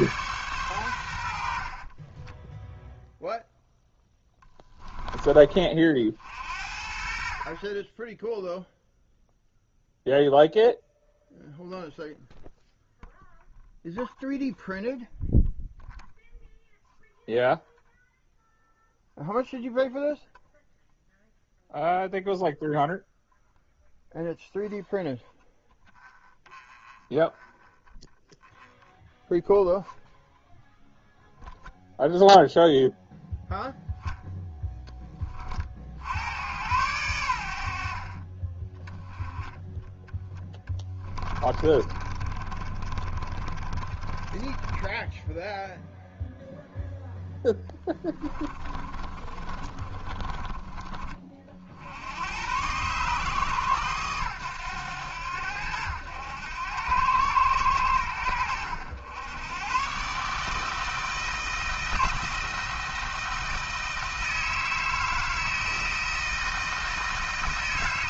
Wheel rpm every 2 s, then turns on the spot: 110, 0, 10, 60, 0, 0, 0, 0, 0, 0, 0, 0, 0, 0, 0, 0, 0, 10, 100, 10, 10, 30, 20, 0, 30, 30, 120, 100, 100, 90, 160, 160, 160, 160.
40-46 48-50